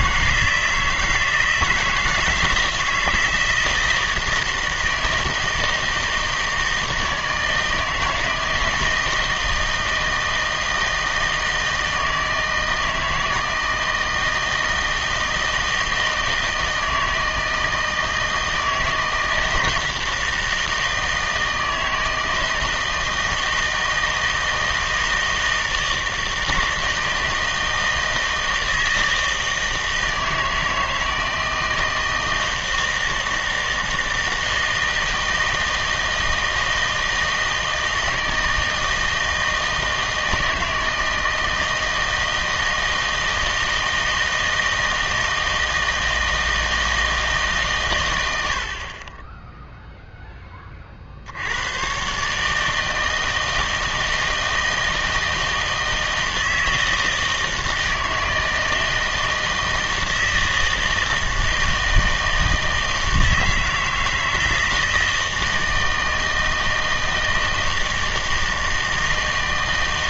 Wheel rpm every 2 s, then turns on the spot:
160, 160, 160, 160, 160, 160, 160, 160, 160, 160, 160, 160, 160, 160, 160, 160, 160, 160, 160, 160, 160, 160, 160, 160, 60, 30, 160, 160, 160, 160, 160, 160, 160, 160, 160.
none